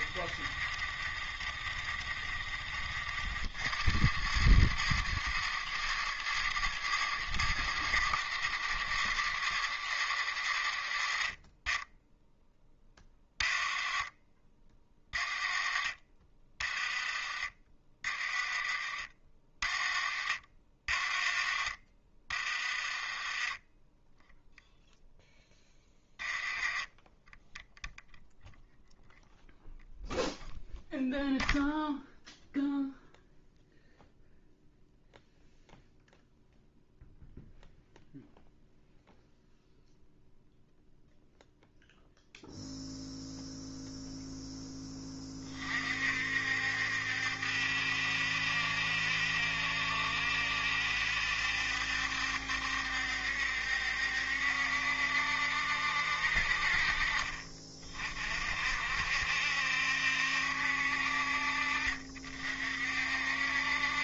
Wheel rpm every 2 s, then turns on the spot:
30, 40, 90, 90, 90, 60, 20, 30, 30, 40, 50, 40, 0, 20, 0, 0, 0, 0, 0, 0, 0, 0, 10, 70, 70, 70, 70, 70, 50, 60, 60, 50.
16-18 22-24 26-28